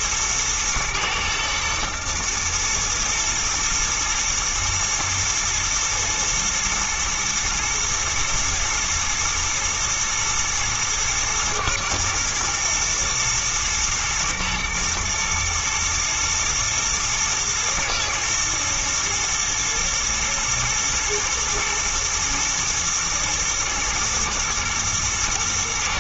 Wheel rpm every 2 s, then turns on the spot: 120, 110, 120, 110, 110, 120, 120, 110, 110, 120, 110, 110, 120.
none